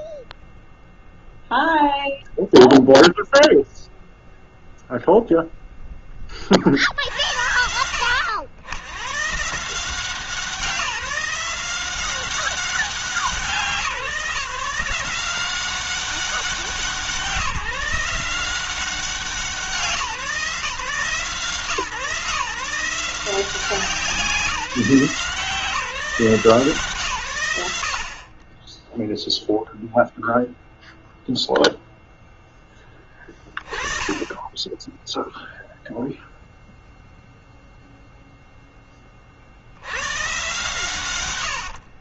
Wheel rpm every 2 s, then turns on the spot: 0, 0, 0, 70, 110, 170, 180, 170, 170, 180, 150, 170, 160, 140, 0, 0, 10, 10, 0, 20, 110.
none